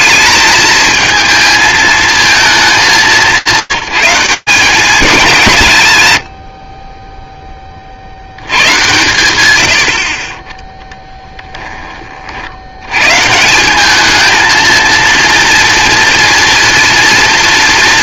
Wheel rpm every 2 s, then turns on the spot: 220, 190, 170, 60, 120, 10, 100, 230, 230.
none